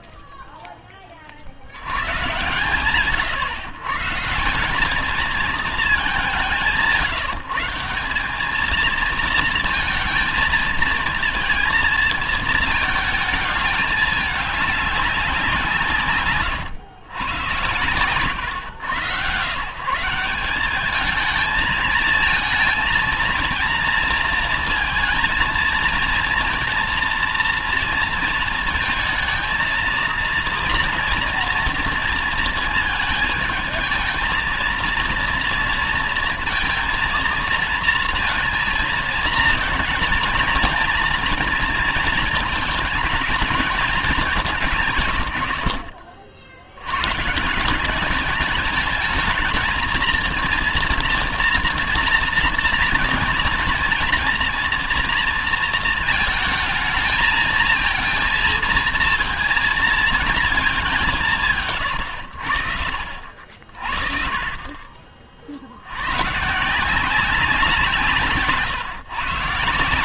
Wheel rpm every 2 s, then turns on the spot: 10, 120, 170, 170, 200, 230, 220, 210, 140, 110, 190, 220, 220, 230, 230, 230, 230, 220, 230, 220, 230, 230, 190, 70, 210, 220, 230, 230, 220, 230, 220, 90, 50, 130, 150.
68-70